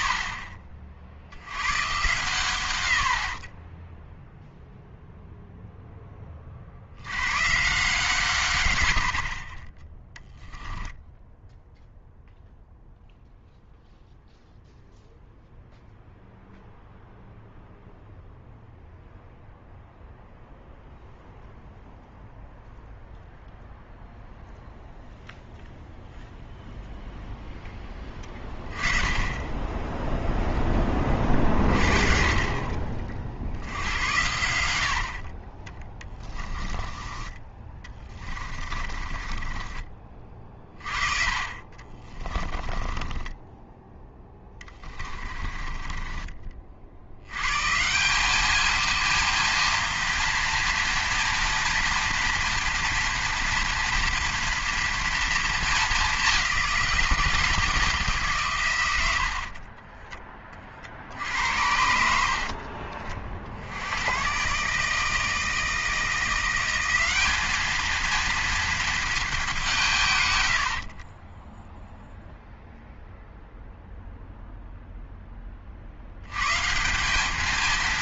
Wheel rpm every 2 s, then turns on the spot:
40, 110, 0, 70, 100, 10, 0, 0, 0, 0, 0, 0, 0, 0, 20, 20, 40, 70, 20, 30, 30, 20, 20, 60, 220, 240, 230, 230, 190, 110, 40, 50, 150, 190, 230, 50, 0, 0, 160.
8-12 28-30 36-40 42-46 62-64